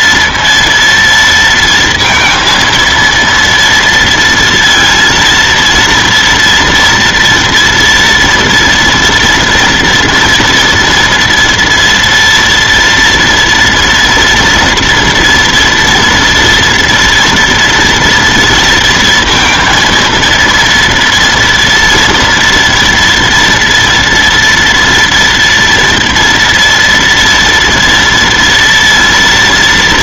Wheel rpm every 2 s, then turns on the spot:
230, 230, 230, 230, 240, 230, 230, 230, 230, 230, 230, 230, 230, 230, 230.
none